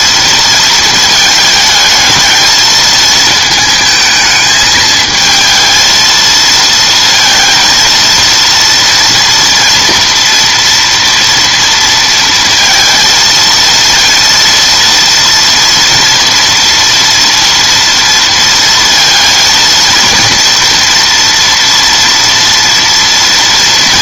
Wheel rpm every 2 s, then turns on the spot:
220, 220, 220, 230, 230, 230, 230, 230, 230, 230, 230, 230.
none